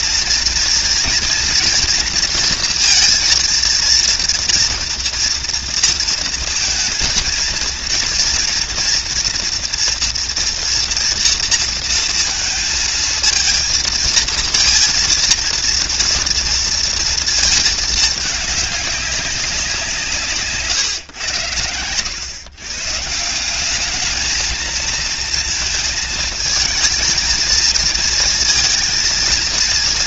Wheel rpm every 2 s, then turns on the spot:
230, 240, 230, 230, 230, 230, 230, 230, 230, 210, 170, 110, 210, 220, 230.
none